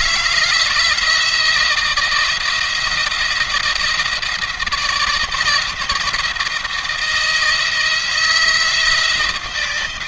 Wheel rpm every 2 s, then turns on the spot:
170, 170, 170, 170, 160.
none